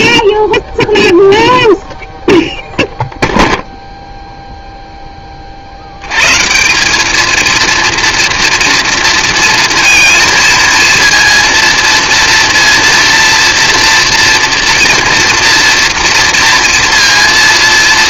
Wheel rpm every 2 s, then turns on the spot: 0, 0, 0, 160, 230, 230, 230, 230, 230.
none